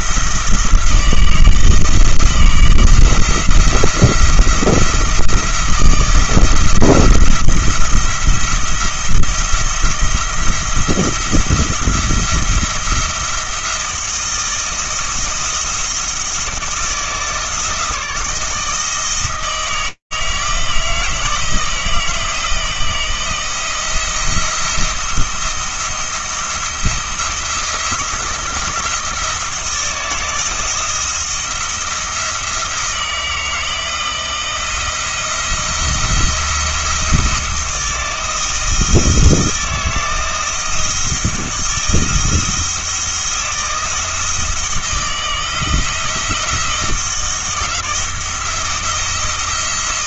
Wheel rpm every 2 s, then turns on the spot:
170, 170, 170, 170, 170, 170, 170, 160, 170, 160, 160, 170, 170, 170, 170, 170, 170, 170, 170, 170, 170, 170, 170, 170, 170.
none